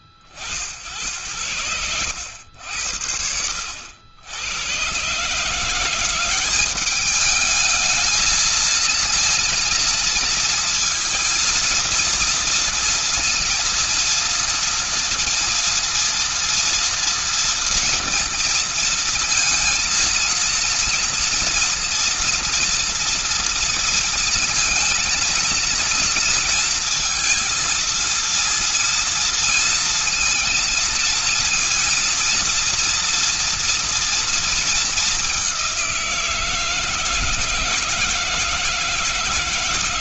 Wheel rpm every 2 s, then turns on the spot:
50, 70, 120, 200, 220, 230, 230, 230, 230, 230, 230, 230, 230, 230, 230, 230, 230, 210, 160, 160.
none